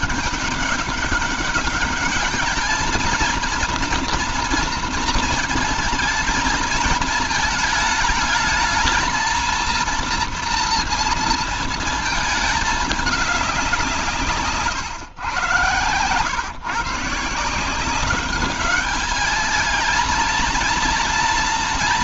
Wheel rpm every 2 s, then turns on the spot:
200, 210, 230, 220, 220, 230, 220, 150, 120, 200, 230.
none